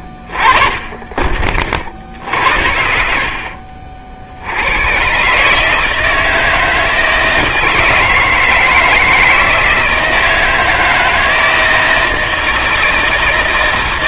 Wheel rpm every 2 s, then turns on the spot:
30, 60, 80, 160, 160, 160, 160.
none